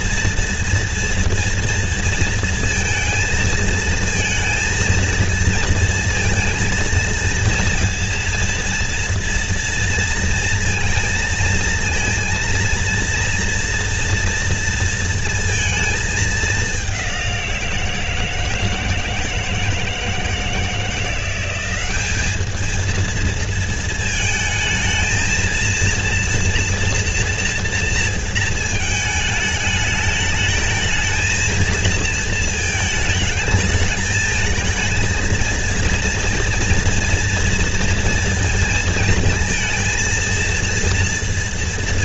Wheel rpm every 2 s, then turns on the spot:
230, 230, 230, 230, 230, 230, 230, 230, 210, 160, 160, 210, 220, 230, 220, 220, 220, 220, 230, 230, 230.
none